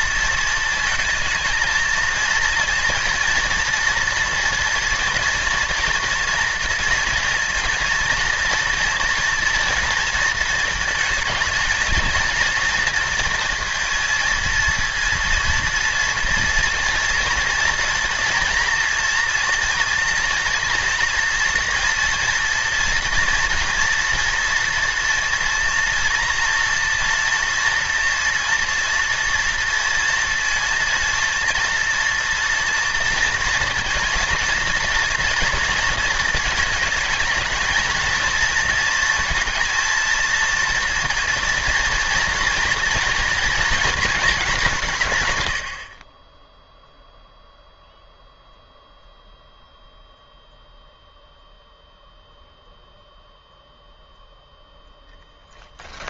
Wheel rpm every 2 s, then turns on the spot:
220, 230, 230, 230, 240, 230, 230, 230, 230, 230, 230, 230, 230, 230, 230, 230, 230, 230, 220, 230, 230, 230, 180, 0, 0, 0, 0, 0.
none